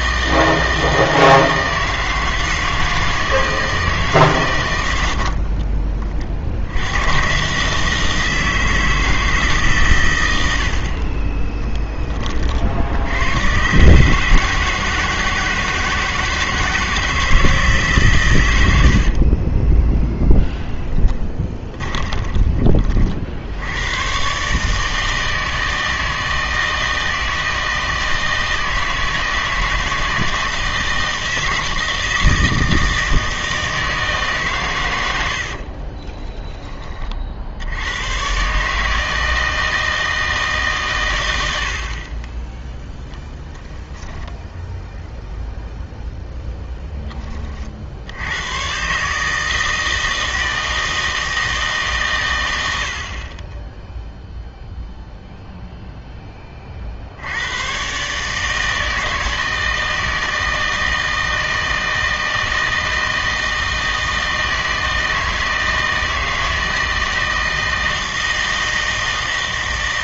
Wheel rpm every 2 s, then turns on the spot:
160, 160, 100, 90, 160, 60, 70, 150, 160, 80, 10, 30, 150, 160, 160, 160, 160, 130, 30, 150, 140, 0, 0, 0, 120, 160, 120, 0, 30, 160, 160, 160, 160, 160, 160.
18-22